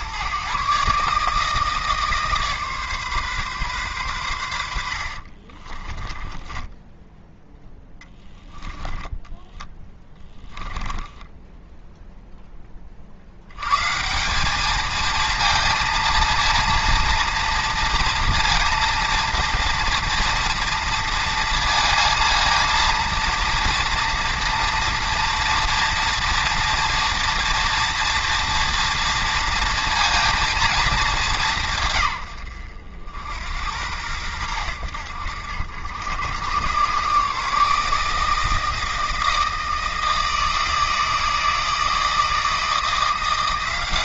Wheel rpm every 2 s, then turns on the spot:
140, 140, 70, 10, 10, 10, 40, 220, 230, 230, 230, 230, 230, 230, 230, 220, 80, 90, 120, 160, 160, 170.
4-12